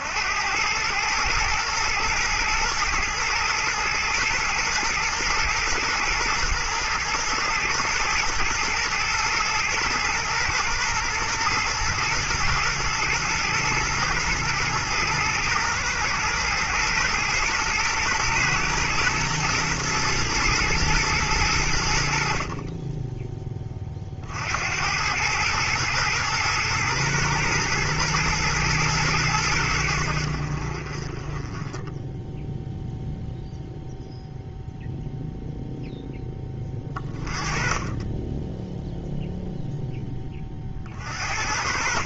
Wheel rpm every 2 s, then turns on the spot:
120, 110, 120, 120, 110, 110, 110, 110, 110, 110, 100, 20, 100, 110, 90, 20, 0, 0, 20, 0, 40.
none